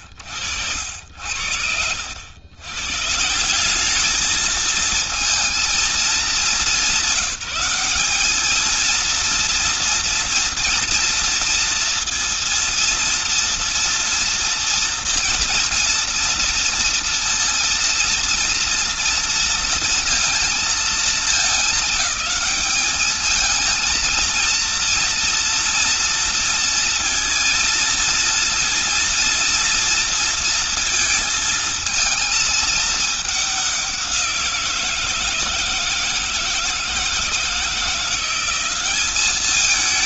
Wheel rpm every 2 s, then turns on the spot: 80, 130, 220, 200, 220, 230, 230, 230, 230, 230, 220, 210, 230, 230, 230, 230, 220, 180, 160, 190.
none